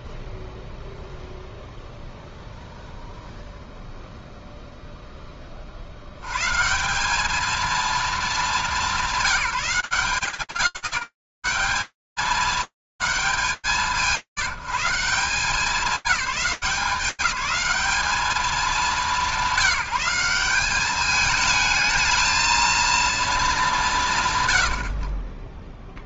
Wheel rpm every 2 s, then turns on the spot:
0, 0, 140, 220, 170, 200, 170, 190, 200, 200, 220, 60, 50.
none